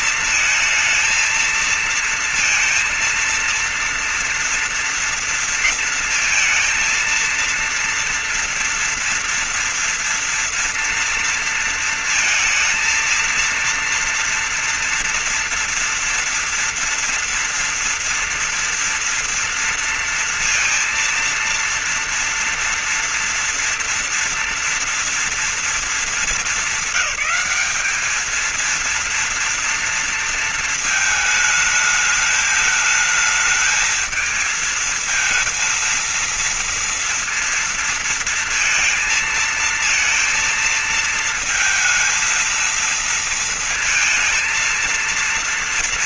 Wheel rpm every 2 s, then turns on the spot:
220, 230, 230, 230, 230, 230, 230, 230, 230, 230, 230, 230, 230, 230, 220, 230, 220, 220, 230, 230, 230, 230, 230.
none